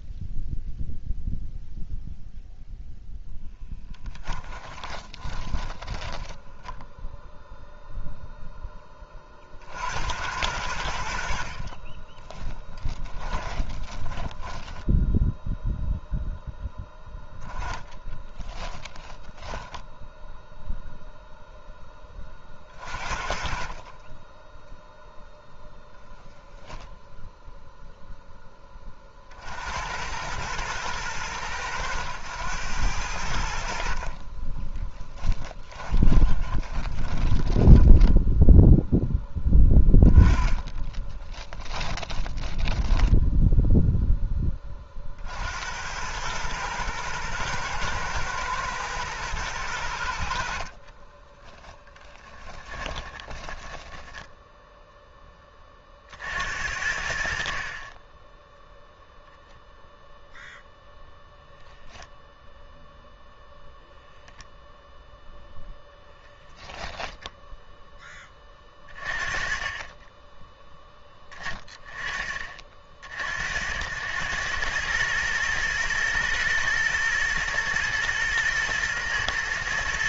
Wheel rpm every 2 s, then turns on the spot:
0, 0, 10, 0, 10, 80, 10, 10, 10, 10, 0, 40, 0, 0, 20, 110, 100, 20, 20, 0, 20, 10, 30, 110, 110, 40, 20, 10, 70, 10, 0, 0, 0, 20, 20, 10, 50, 110, 110, 110.
4-6 12-16 18-20 34-38 40-44 50-54 66-68